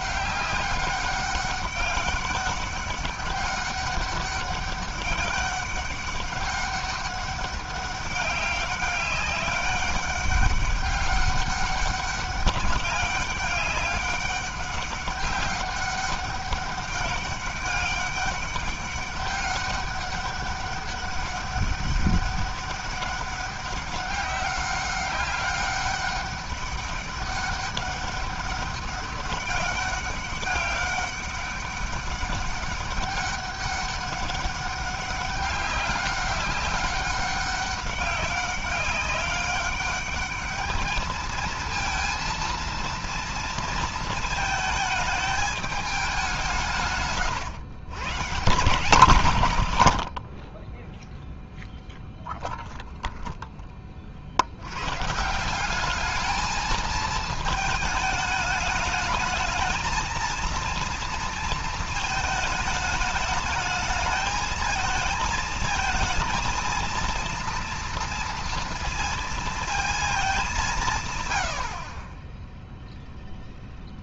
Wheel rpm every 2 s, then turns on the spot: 200, 200, 200, 200, 200, 200, 200, 200, 200, 200, 200, 200, 190, 200, 200, 200, 200, 200, 190, 190, 220, 230, 220, 150, 160, 0, 0, 130, 220, 220, 230, 210, 220, 230, 230, 190, 0.
none